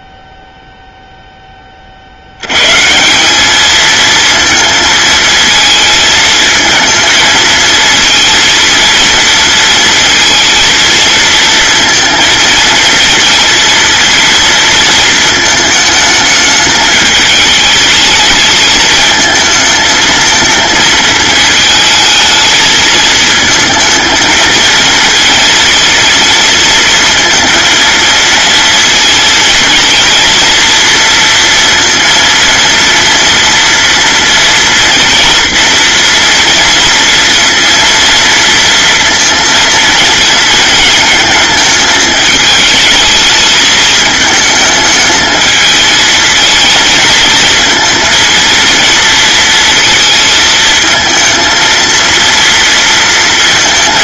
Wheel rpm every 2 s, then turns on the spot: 0, 150, 220, 230, 230, 230, 230, 230, 210, 210, 220, 220, 230, 230, 230, 230, 230, 230, 230, 230, 230, 220, 220, 220, 230, 220, 230.
none